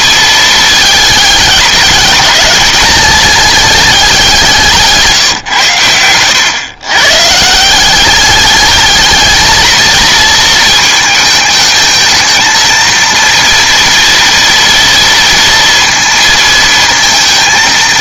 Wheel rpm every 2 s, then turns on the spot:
220, 210, 170, 130, 210, 220, 230, 230, 230.
none